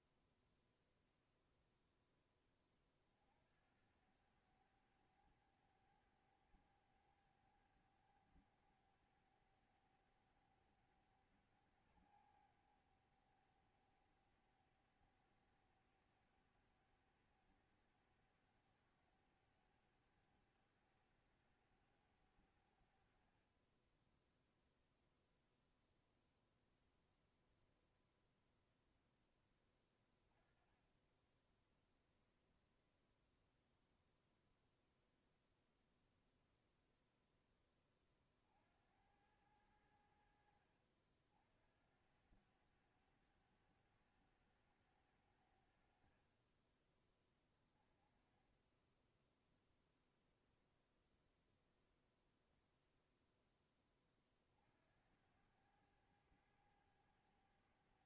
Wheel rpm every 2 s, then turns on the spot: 0, 10, 90, 100, 100, 100, 100, 100, 100, 100, 100, 90, 10, 0, 0, 10, 0, 0, 0, 40, 70, 80, 100, 40, 20, 0, 0, 30, 100.
none